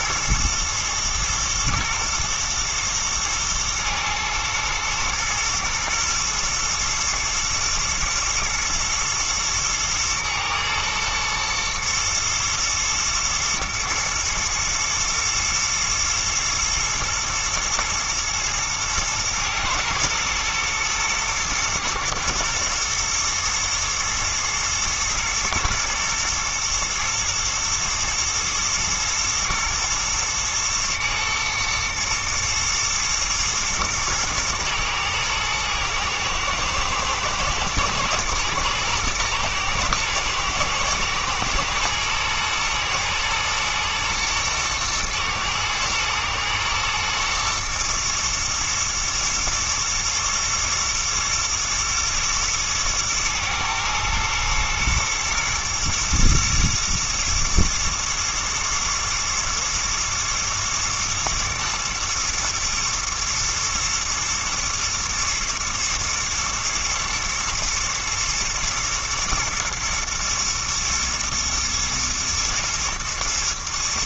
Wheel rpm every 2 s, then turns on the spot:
110, 110, 120, 120, 110, 110, 110, 120, 110, 120, 120, 120, 120, 120, 110, 110, 120, 110, 110, 110, 110, 110, 110, 120, 110, 120, 110, 110, 120, 120, 110, 110, 120, 110, 110, 110, 120.
none